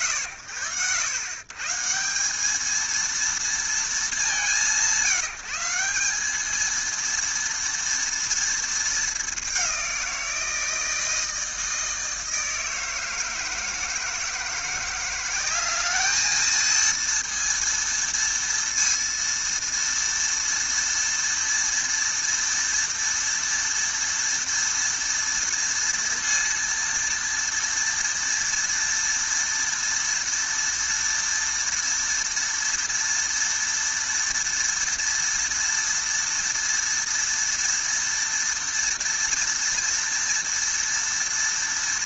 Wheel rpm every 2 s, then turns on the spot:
120, 230, 170, 230, 190, 160, 160, 200, 230, 230, 230, 230, 230, 230, 230, 230, 230, 230, 230, 230, 230.
none